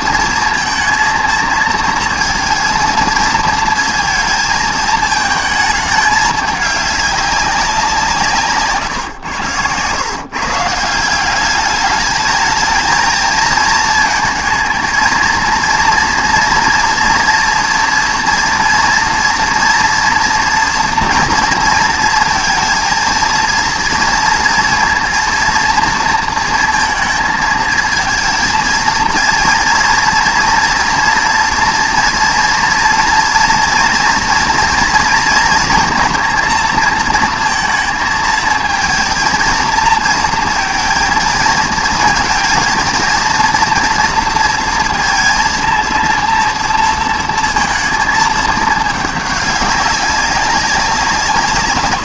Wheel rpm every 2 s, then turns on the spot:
230, 230, 220, 210, 140, 160, 220, 230, 230, 230, 240, 230, 230, 230, 230, 230, 230, 230, 220, 230, 230, 230, 230, 230, 210, 190.
8-10